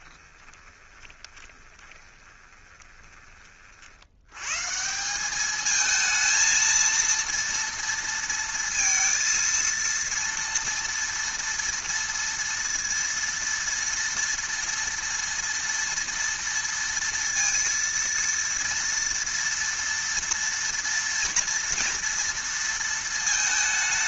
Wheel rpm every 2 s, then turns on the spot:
20, 20, 130, 230, 230, 230, 230, 230, 230, 230, 240, 230.
0-4